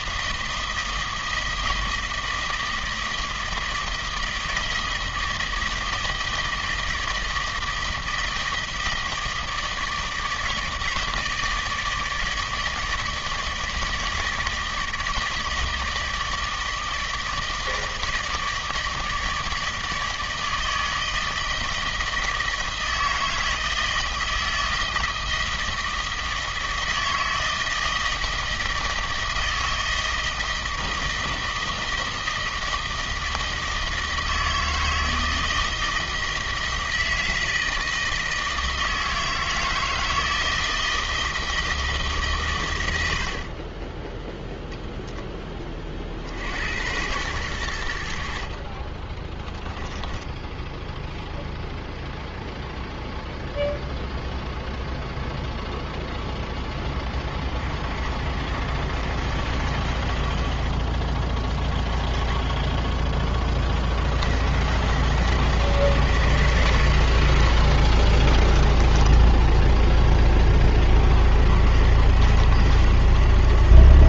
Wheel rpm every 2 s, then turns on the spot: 160, 160, 160, 160, 160, 160, 160, 160, 160, 160, 160, 160, 160, 160, 160, 160, 160, 160, 160, 160, 160, 90, 20, 100, 30, 0, 0, 0, 10, 60, 20, 10, 80, 60, 10, 40, 80.
68-70